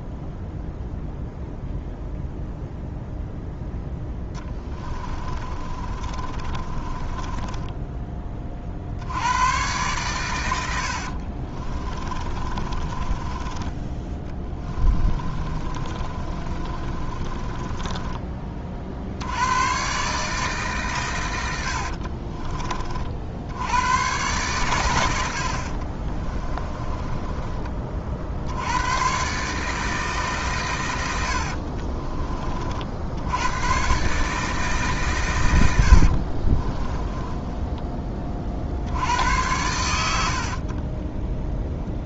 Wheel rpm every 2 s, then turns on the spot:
0, 0, 20, 20, 60, 70, 20, 20, 30, 50, 140, 40, 120, 20, 100, 110, 60, 140, 20, 60, 40.
4-8 10-18 26-28 36-38 40-42